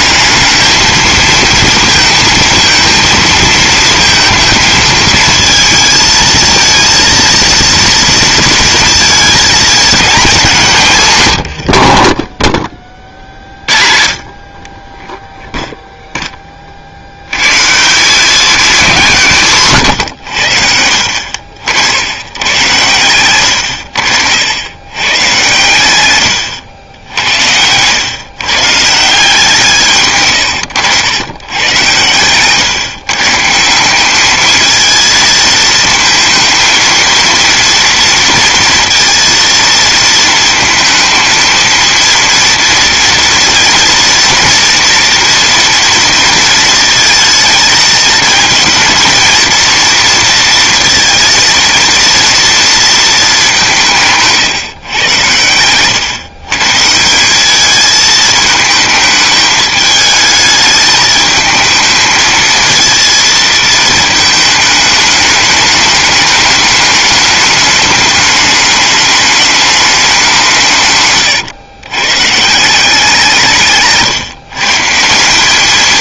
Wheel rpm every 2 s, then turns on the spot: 220, 230, 230, 230, 230, 190, 30, 40, 40, 210, 80, 110, 110, 100, 140, 110, 130, 220, 230, 230, 220, 230, 240, 230, 230, 230, 230, 140, 140, 220, 210, 220, 220, 210, 210, 160, 170, 140.
none